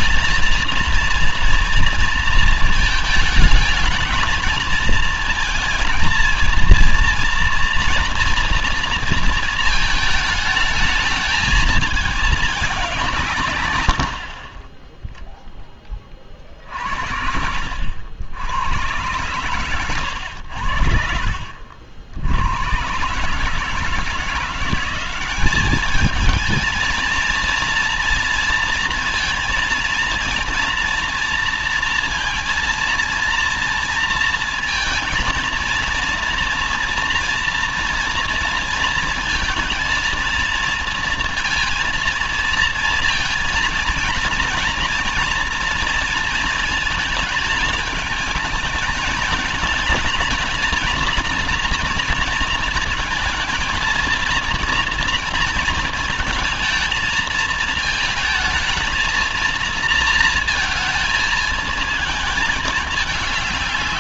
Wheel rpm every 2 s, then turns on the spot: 230, 220, 220, 230, 240, 220, 200, 30, 50, 100, 80, 100, 170, 220, 230, 230, 230, 230, 230, 230, 230, 230, 230, 220, 210, 220, 230, 230, 230, 230, 230, 220.
none